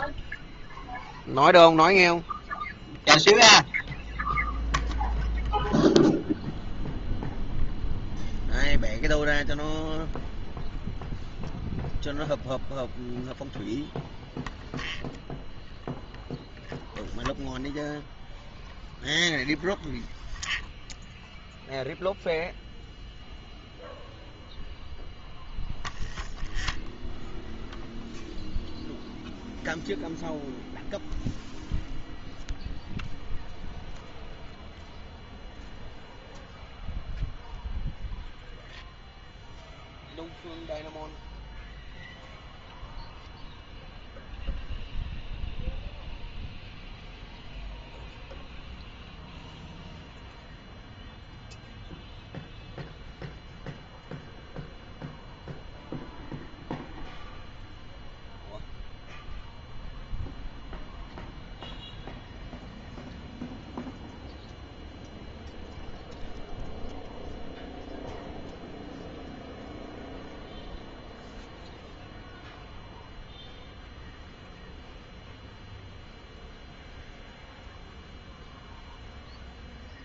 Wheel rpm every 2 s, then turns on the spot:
0, 0, 0, 0, 0, 0, 0, 0, 0, 0, 0, 0, 0, 0, 0, 0, 0, 0, 0, 0, 0, 0, 0, 0, 0, 0, 0, 0, 0, 0, 0, 0, 0, 0, 0, 0, 0, 0, 0, 0.
none